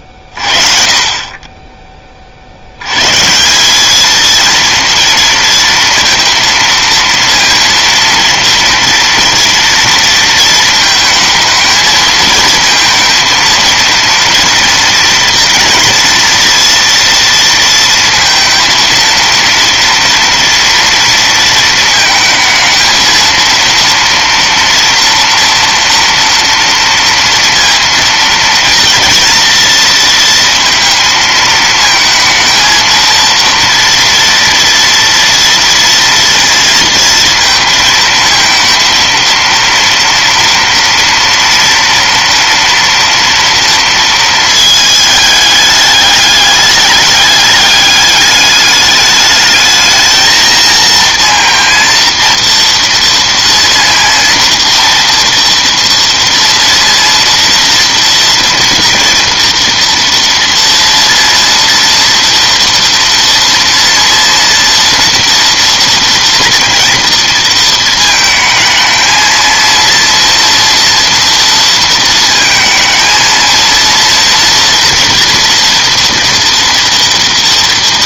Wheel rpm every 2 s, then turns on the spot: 20, 200, 230, 230, 230, 220, 230, 230, 230, 230, 220, 230, 230, 230, 230, 220, 230, 230, 230, 230, 230, 230, 210, 210, 220, 230, 230, 230, 240, 230, 230, 230, 240, 220, 230, 230, 230, 240, 230.
none